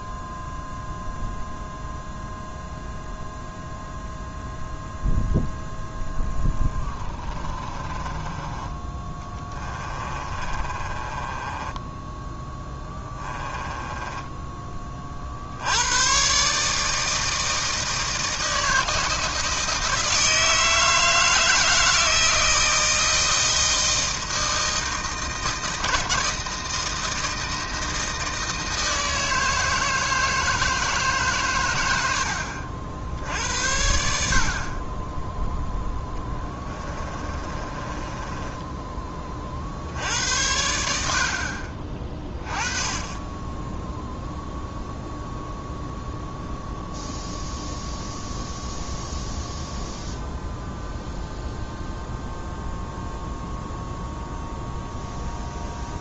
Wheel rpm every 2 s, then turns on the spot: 0, 0, 0, 30, 20, 30, 10, 30, 150, 160, 160, 160, 160, 160, 160, 160, 60, 30, 20, 20, 70, 20, 0, 0, 0, 0, 0, 0.
6-8 10-14 36-38